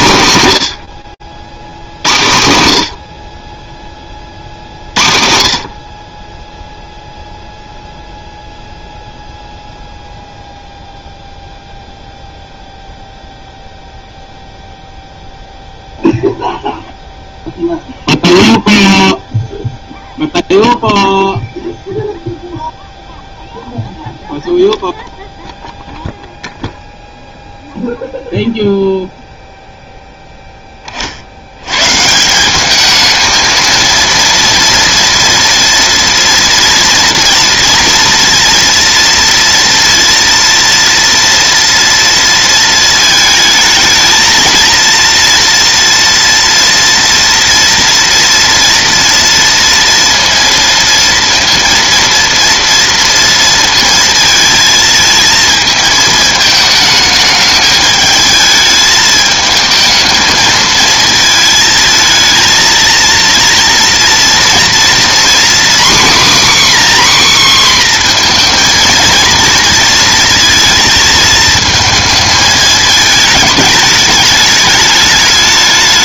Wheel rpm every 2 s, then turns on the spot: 110, 70, 60, 0, 0, 0, 0, 0, 0, 0, 0, 0, 0, 0, 0, 40, 210, 230, 240, 230, 230, 220, 230, 230, 230, 230, 230, 230, 210, 220, 220, 230, 240, 270, 230, 230, 220, 210.
none